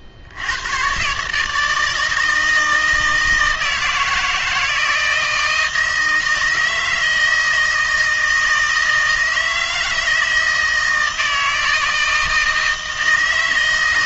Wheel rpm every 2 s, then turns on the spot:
90, 160, 160, 160, 160, 160, 160.
none